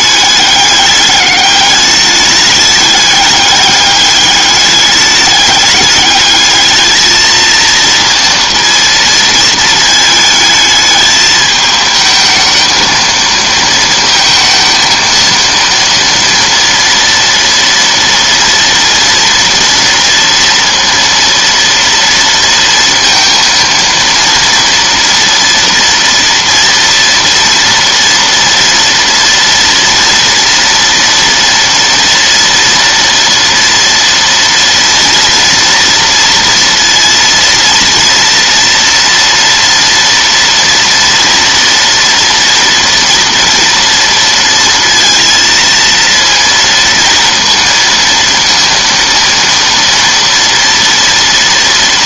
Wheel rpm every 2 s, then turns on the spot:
210, 210, 210, 220, 230, 220, 220, 220, 230, 230, 230, 230, 230, 230, 240, 230, 230, 240, 230, 230, 230, 230, 230, 230, 230, 230.
none